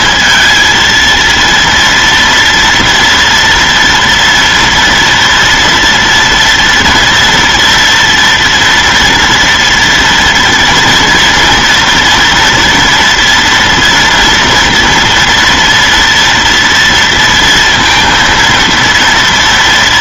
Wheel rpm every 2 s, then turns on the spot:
230, 230, 230, 230, 230, 230, 230, 230, 240, 230.
none